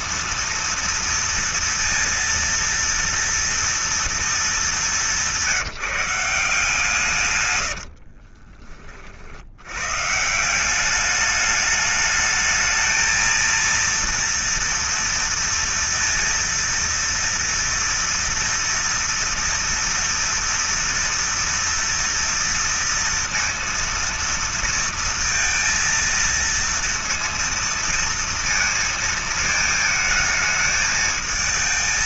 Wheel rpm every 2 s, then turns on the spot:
230, 230, 230, 180, 60, 150, 220, 240, 230, 230, 230, 240, 230, 230, 230, 220.
8-10